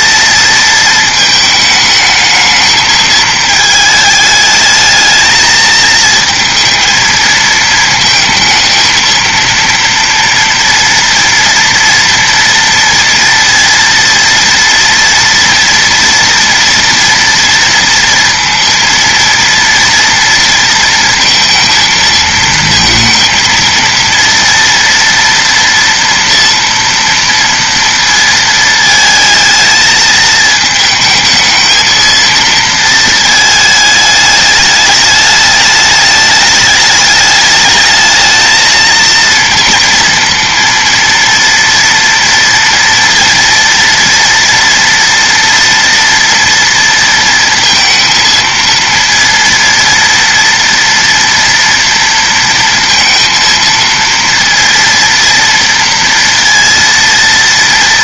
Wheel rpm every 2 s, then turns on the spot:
230, 220, 220, 230, 220, 230, 230, 230, 230, 230, 230, 230, 230, 230, 220, 220, 230, 210, 210, 230, 230, 230, 230, 230, 230, 230, 230, 230, 230.
none